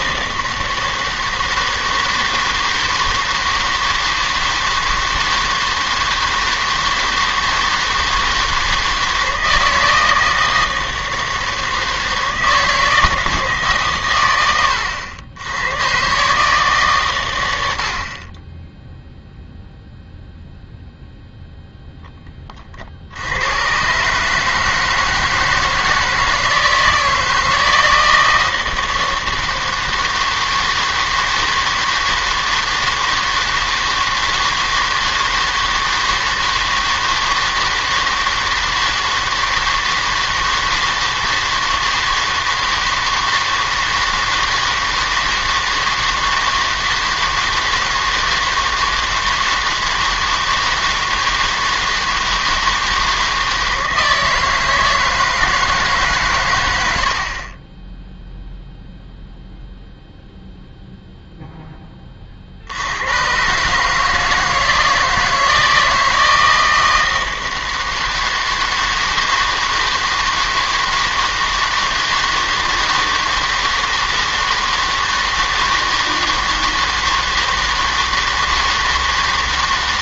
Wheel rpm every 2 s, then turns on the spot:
160, 160, 160, 160, 160, 160, 160, 100, 140, 10, 0, 50, 150, 160, 160, 160, 160, 160, 160, 160, 160, 160, 160, 160, 160, 160, 160, 160, 100, 0, 0, 70, 160, 160, 160, 160, 160, 160, 160, 160.
none